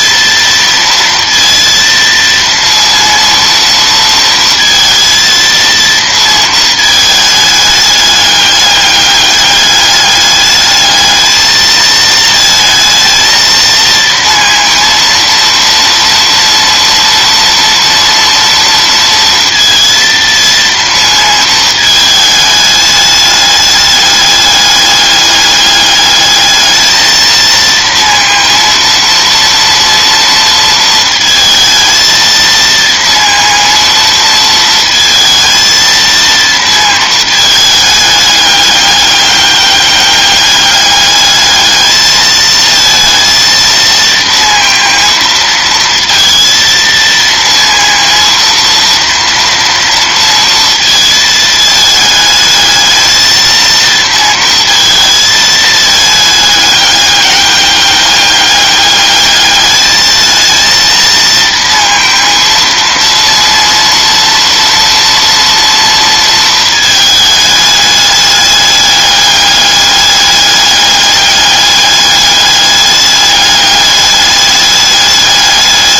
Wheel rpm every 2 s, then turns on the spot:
230, 230, 230, 220, 200, 210, 220, 230, 230, 230, 230, 210, 210, 220, 230, 230, 230, 220, 220, 200, 210, 230, 230, 230, 230, 220, 220, 230, 200, 210, 230, 230, 230, 220, 210, 200, 210, 210.
none